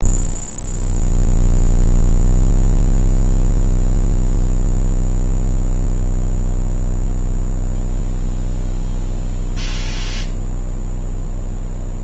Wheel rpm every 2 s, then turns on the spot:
0, 0, 0, 0, 0, 0.
none